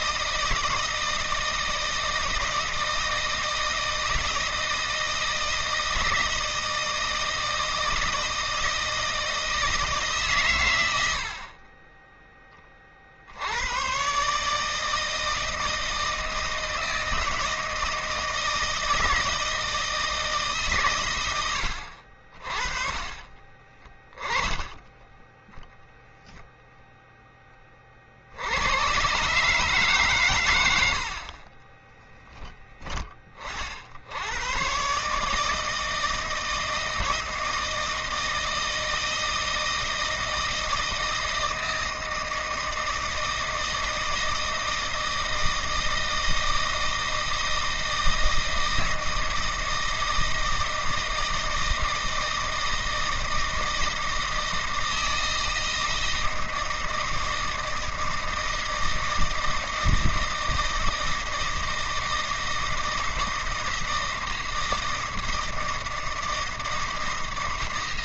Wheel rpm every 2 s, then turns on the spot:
160, 160, 160, 160, 160, 100, 20, 150, 160, 160, 130, 30, 10, 0, 90, 100, 20, 130, 160, 160, 160, 160, 160, 160, 160, 160, 160, 160, 160, 160, 160, 160, 160, 160.
none